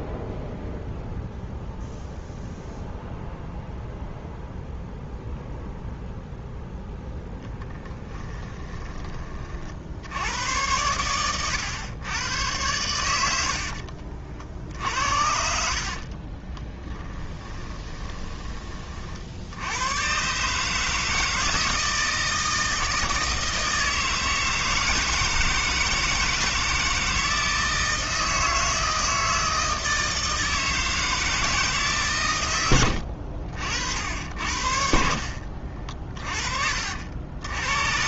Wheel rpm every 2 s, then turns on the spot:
0, 0, 0, 0, 20, 100, 90, 70, 20, 40, 150, 160, 160, 160, 160, 160, 80, 60, 60.
14-18 32-34